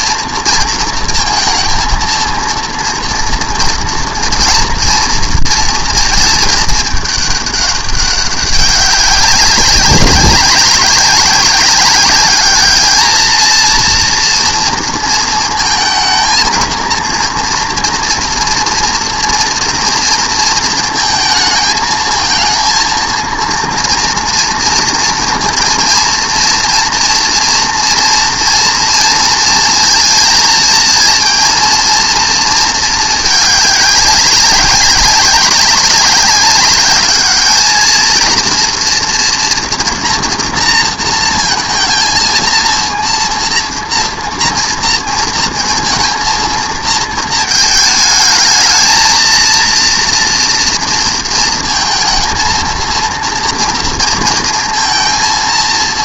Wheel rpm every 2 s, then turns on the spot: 230, 230, 230, 210, 200, 190, 210, 230, 230, 230, 230, 230, 230, 230, 230, 230, 220, 200, 200, 230, 240, 230, 230, 230, 220, 230, 230, 230.
none